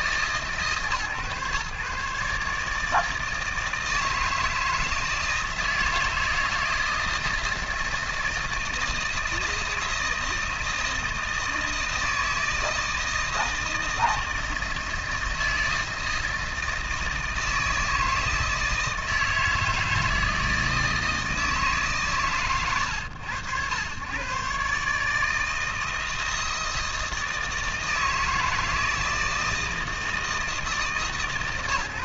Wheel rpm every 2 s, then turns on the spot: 130, 160, 160, 160, 160, 160, 160, 160, 160, 160, 160, 110, 150, 160, 160, 150.
none